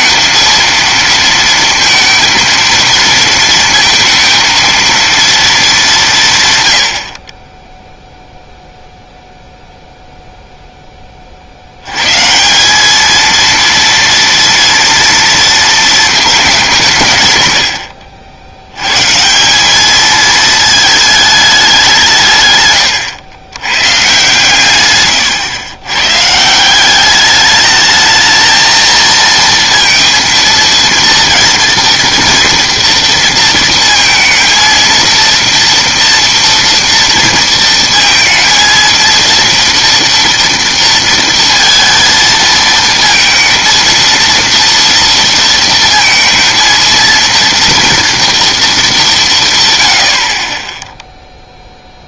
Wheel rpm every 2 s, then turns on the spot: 230, 230, 230, 130, 0, 0, 180, 230, 190, 90, 220, 130, 120, 170, 220, 230, 230, 230, 230, 230, 230, 230, 230, 220, 230, 20.
none